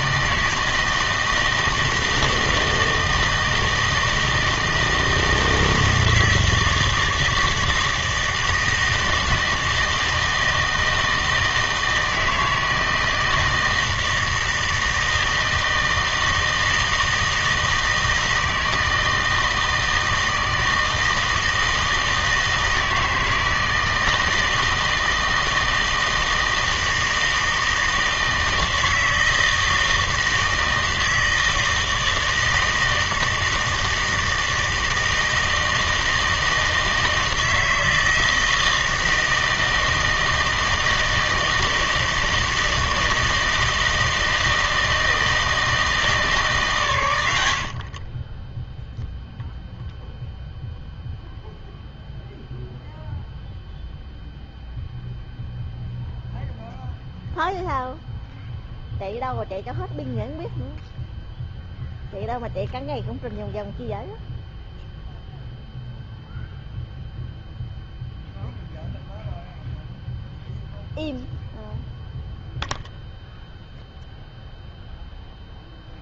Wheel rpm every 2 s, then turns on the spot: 160, 160, 160, 160, 160, 160, 160, 160, 160, 160, 160, 160, 160, 160, 160, 160, 160, 160, 160, 160, 160, 160, 160, 140, 10, 0, 0, 0, 0, 0, 0, 0, 0, 0, 0, 0, 0, 0.
none